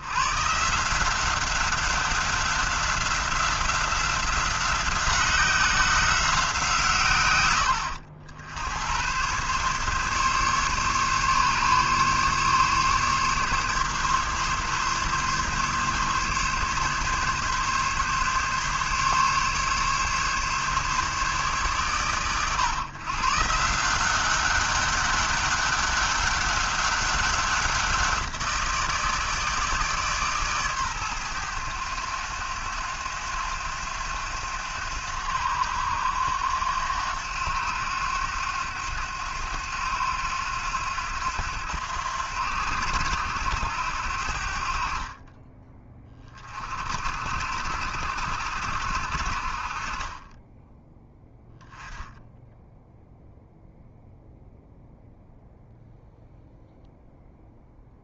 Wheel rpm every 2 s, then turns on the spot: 160, 190, 180, 160, 90, 140, 140, 140, 140, 140, 140, 130, 190, 190, 170, 130, 90, 90, 90, 90, 90, 80, 50, 40, 70, 10, 0, 0, 0.
none